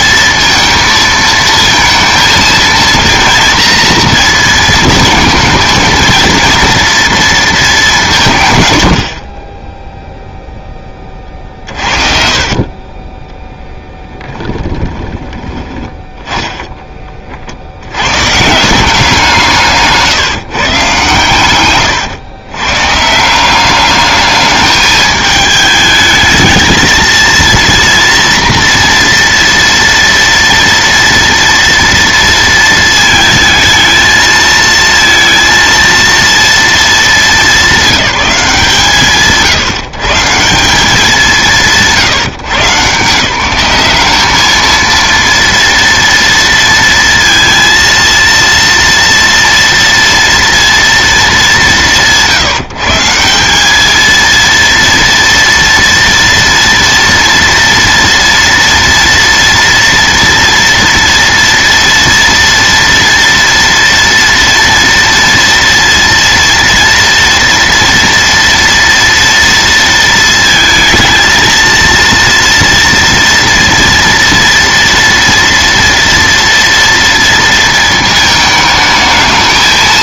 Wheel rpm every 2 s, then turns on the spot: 230, 230, 220, 230, 70, 20, 20, 10, 20, 170, 130, 140, 210, 230, 230, 230, 220, 230, 210, 130, 160, 150, 230, 230, 230, 230, 160, 230, 230, 230, 230, 230, 230, 230, 230, 220, 230, 230, 230, 210.
12-16